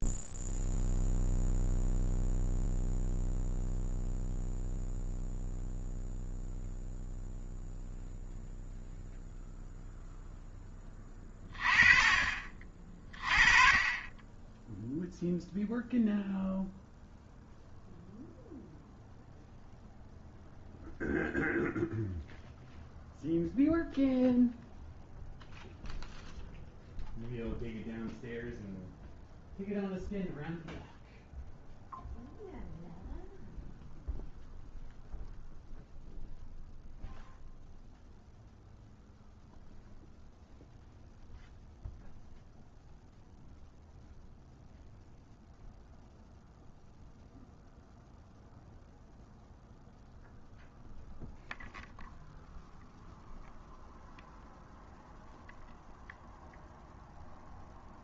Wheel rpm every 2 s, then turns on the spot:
0, 0, 0, 0, 0, 30, 30, 0, 0, 0, 0, 0, 0, 0, 0, 0, 0, 0, 0, 0, 0, 0, 0, 0, 0, 0, 0, 0, 0.
none